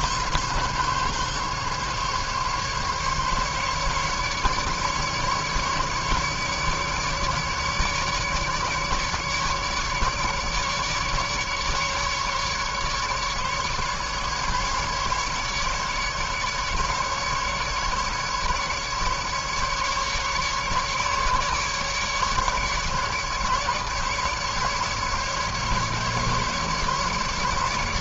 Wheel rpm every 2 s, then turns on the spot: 140, 140, 150, 150, 150, 150, 140, 140, 150, 150, 150, 140, 150, 150.
none